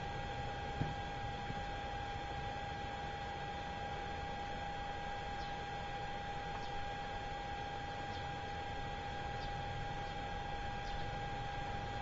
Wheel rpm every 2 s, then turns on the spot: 0, 0, 0, 0, 0, 0.
none